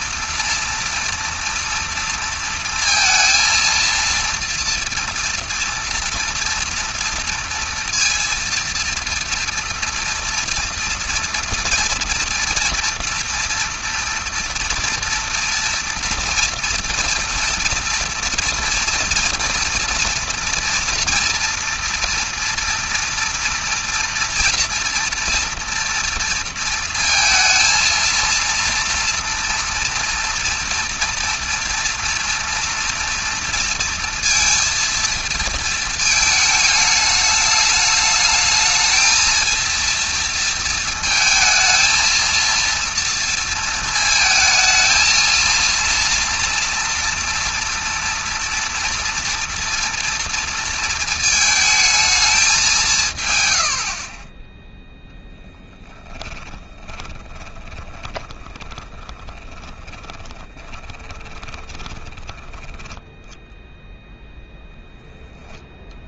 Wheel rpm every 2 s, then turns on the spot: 230, 230, 230, 230, 230, 230, 230, 230, 230, 240, 230, 230, 240, 230, 230, 230, 230, 230, 210, 220, 230, 230, 220, 230, 230, 230, 180, 10, 20, 20, 20, 10, 0.
56-62